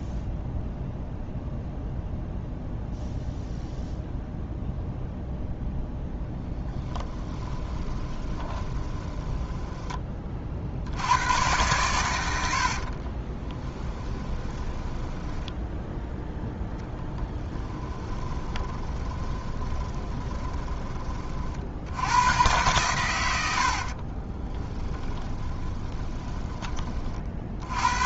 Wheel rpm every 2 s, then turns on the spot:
0, 0, 0, 10, 20, 70, 50, 10, 10, 20, 20, 120, 10, 30.
6-10 12-20 24-26